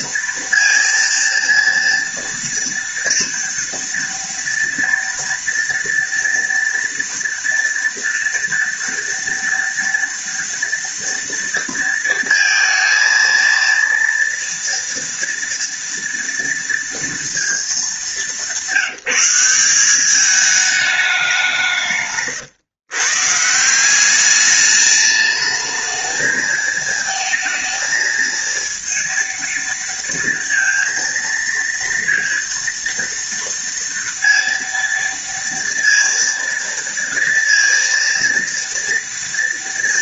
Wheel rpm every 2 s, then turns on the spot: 230, 230, 230, 230, 230, 230, 230, 230, 230, 180, 200, 140, 210, 220, 230, 230, 230, 230, 230, 230.
none